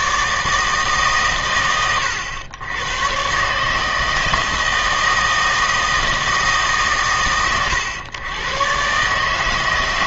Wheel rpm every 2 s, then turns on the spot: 150, 110, 160, 150, 130.
none